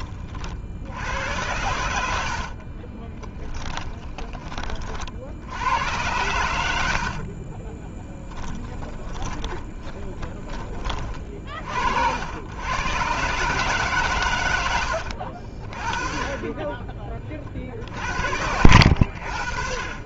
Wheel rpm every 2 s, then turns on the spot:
70, 30, 30, 80, 10, 30, 110, 90, 20, 70.
2-4 6-10 14-18